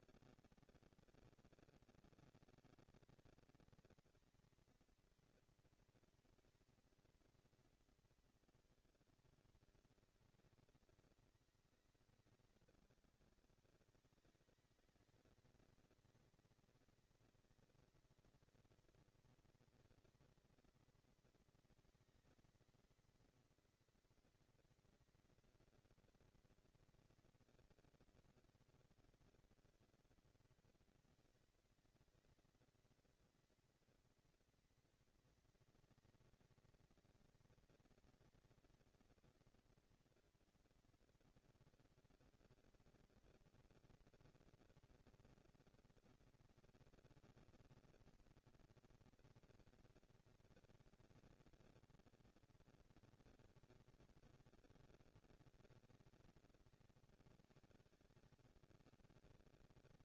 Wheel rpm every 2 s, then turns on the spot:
230, 230, 230, 230, 220, 190, 200, 220, 230, 240, 230, 230, 230, 230, 230, 230, 230, 230, 230, 230, 240, 230, 230, 230, 230, 220, 230, 220, 160, 110.
none